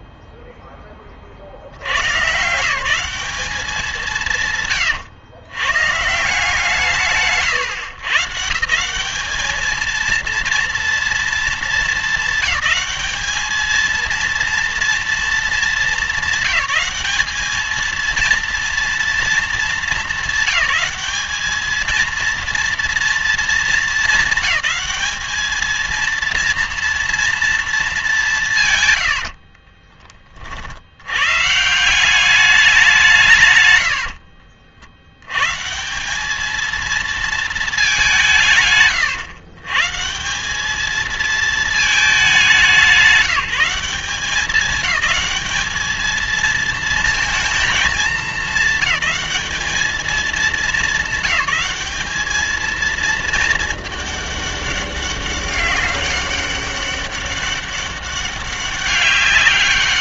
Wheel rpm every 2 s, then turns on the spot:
10, 160, 150, 170, 160, 230, 220, 230, 210, 230, 210, 230, 220, 230, 170, 60, 190, 50, 220, 150, 210, 200, 210, 230, 220, 200, 220, 200, 200, 200.
none